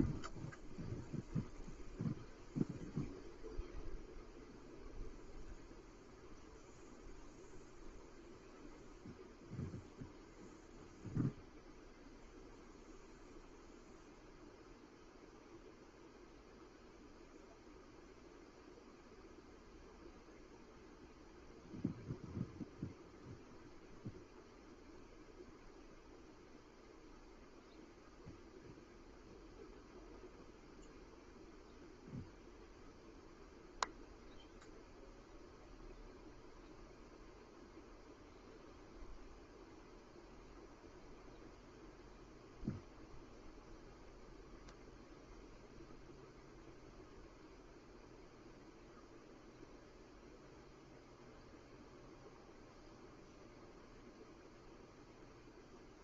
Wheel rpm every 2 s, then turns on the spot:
0, 0, 0, 0, 0, 0, 0, 0, 0, 0, 0, 0, 0, 0, 0, 0, 0, 0, 0, 0, 0, 0, 0, 0, 0, 0, 0, 0.
none